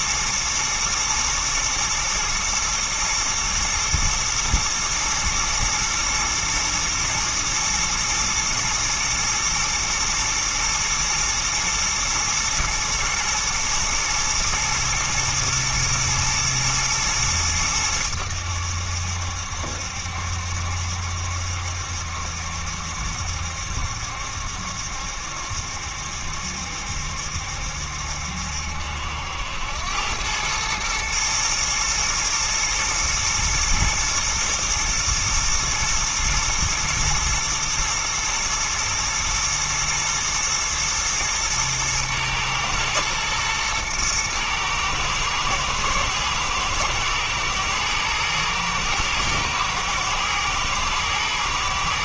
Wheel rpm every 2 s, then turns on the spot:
110, 110, 110, 110, 120, 120, 110, 120, 110, 80, 70, 70, 70, 70, 70, 110, 110, 110, 110, 110, 110, 120, 110, 110, 120, 110.
none